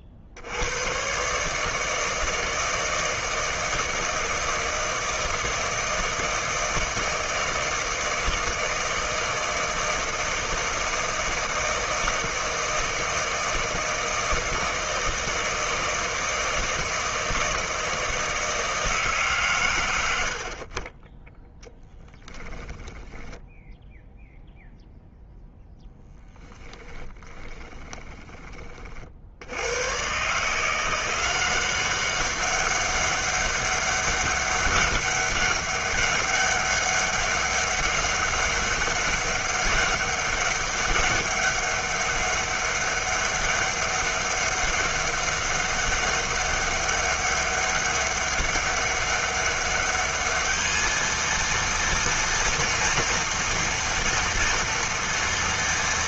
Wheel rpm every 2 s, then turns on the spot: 50, 160, 160, 160, 160, 160, 160, 160, 160, 160, 60, 10, 0, 10, 30, 160, 190, 200, 200, 200, 200, 200, 200, 200, 200, 210, 240, 240.
22-24 26-28